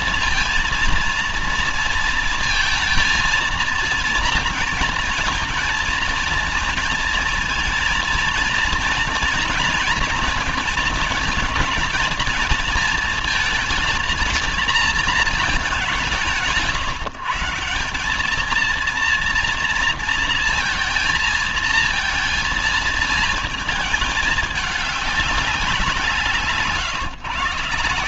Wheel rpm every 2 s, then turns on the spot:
230, 230, 230, 230, 230, 220, 220, 230, 160, 210, 230, 220, 210, 150.
none